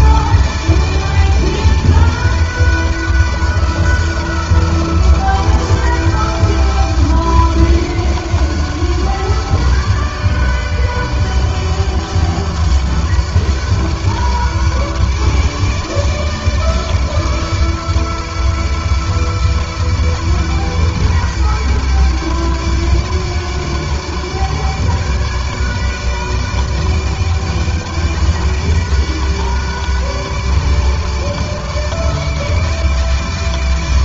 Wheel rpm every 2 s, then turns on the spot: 160, 160, 160, 160, 150, 150, 150, 150, 150, 150, 150, 150, 150, 160, 160, 160, 150.
none